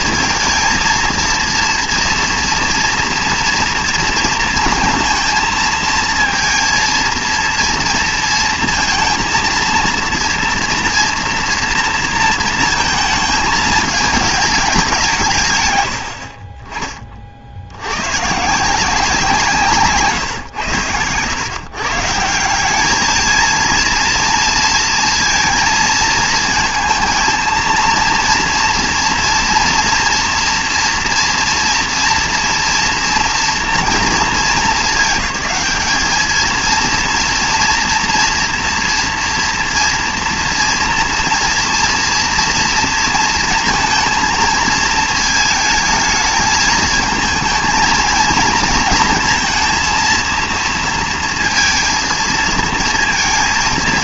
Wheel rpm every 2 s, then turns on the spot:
230, 230, 230, 230, 230, 230, 230, 210, 30, 160, 120, 180, 230, 220, 230, 230, 230, 220, 220, 230, 230, 230, 230, 220, 220, 230, 220.
none